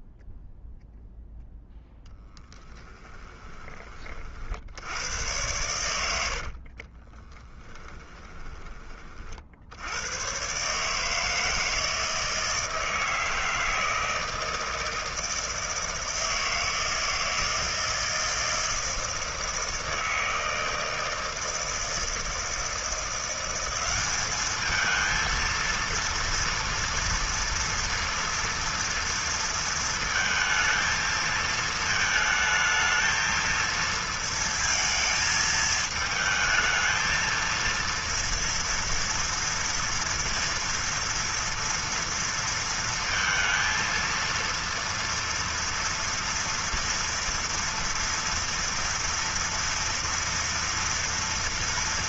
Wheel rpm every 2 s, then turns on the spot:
0, 10, 50, 80, 20, 120, 160, 160, 160, 160, 160, 160, 210, 230, 230, 220, 220, 230, 220, 230, 230, 230, 230, 230, 230, 230.
2-4 6-10